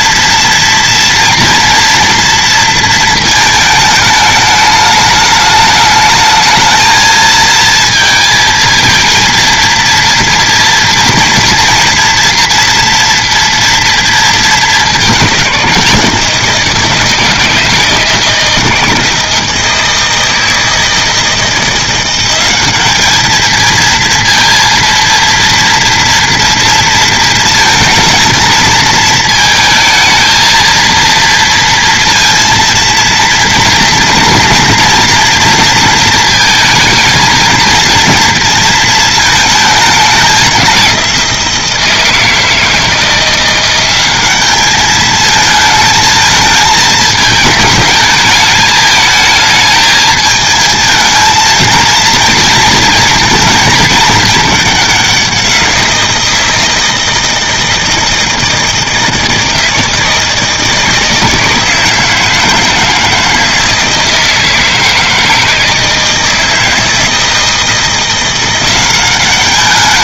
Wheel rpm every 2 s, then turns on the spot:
230, 230, 210, 220, 230, 230, 240, 210, 160, 160, 160, 200, 230, 230, 230, 230, 230, 230, 230, 230, 190, 160, 210, 220, 210, 220, 230, 200, 160, 160, 160, 160, 160, 160, 180.
none